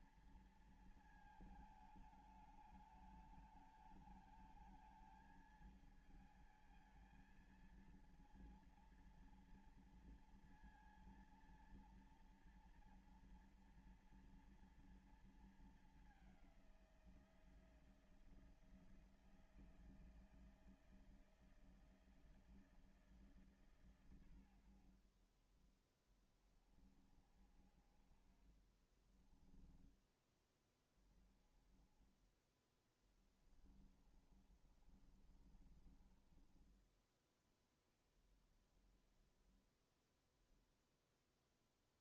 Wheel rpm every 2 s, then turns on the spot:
230, 220, 220, 220, 230, 230, 230, 230, 210, 160, 160, 160, 120, 20, 40, 10, 20, 30, 30, 10, 0.
34-38